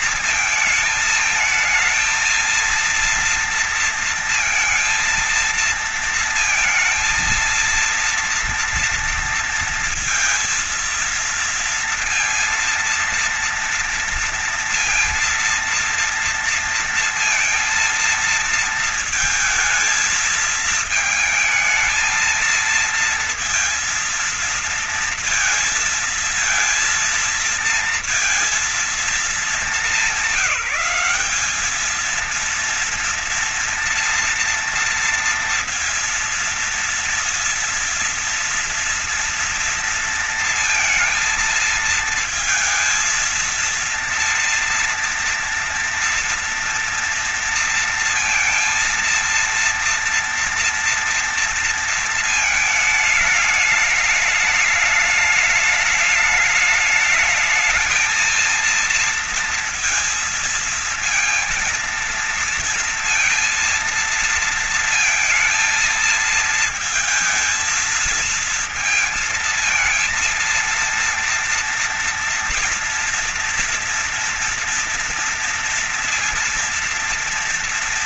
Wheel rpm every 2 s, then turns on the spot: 220, 230, 230, 230, 230, 230, 230, 230, 230, 220, 220, 230, 230, 230, 220, 190, 230, 230, 230, 230, 230, 230, 230, 230, 230, 230, 220, 210, 210, 230, 230, 230, 230, 230, 230, 230, 230, 230, 230.
none